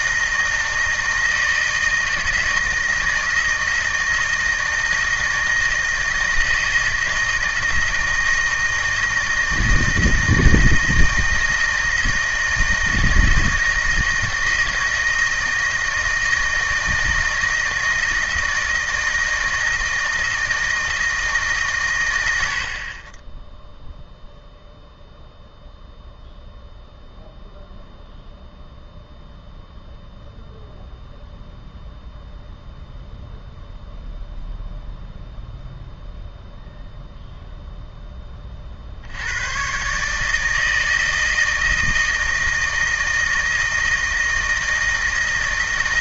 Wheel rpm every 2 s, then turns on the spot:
160, 160, 160, 160, 160, 160, 160, 160, 160, 160, 160, 70, 0, 0, 0, 0, 0, 0, 0, 40, 160, 160, 160.
none